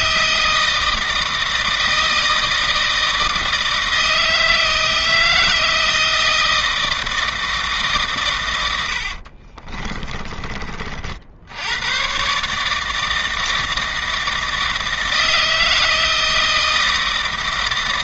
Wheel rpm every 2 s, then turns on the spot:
160, 160, 160, 160, 80, 40, 160, 160, 160.
8-10